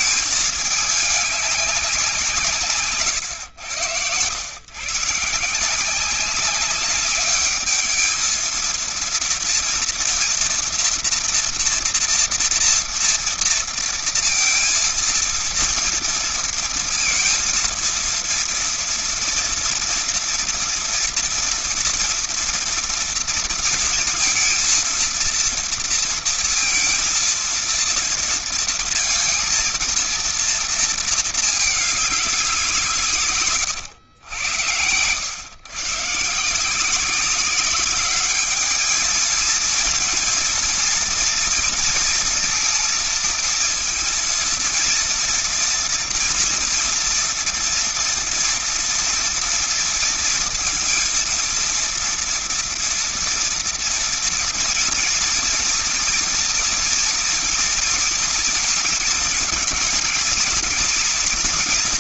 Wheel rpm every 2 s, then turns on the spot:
210, 160, 120, 190, 220, 230, 230, 230, 230, 230, 230, 230, 230, 230, 230, 230, 190, 90, 160, 200, 230, 230, 230, 230, 240, 230, 240, 230, 230, 230, 240.
34-36